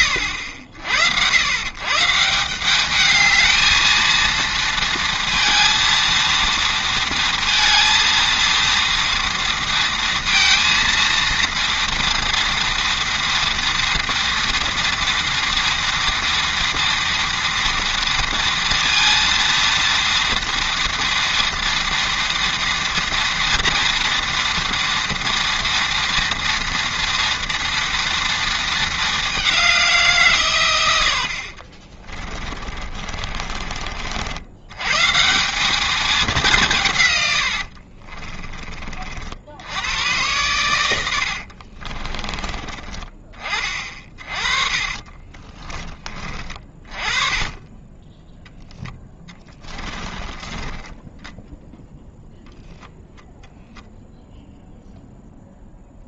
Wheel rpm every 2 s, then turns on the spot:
70, 200, 230, 230, 230, 230, 230, 230, 240, 230, 230, 230, 230, 230, 210, 100, 40, 130, 130, 40, 90, 20, 30, 30, 10, 10, 0, 0.
32-34 44-50